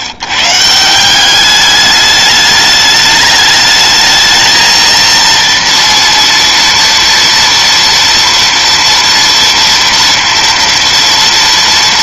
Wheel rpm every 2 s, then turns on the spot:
130, 210, 220, 230, 230, 230.
none